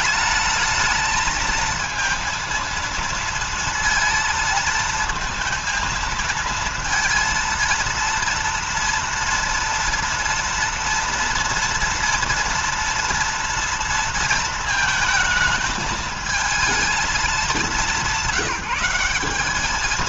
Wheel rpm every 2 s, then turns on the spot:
220, 230, 230, 230, 230, 230, 230, 230, 220, 190.
none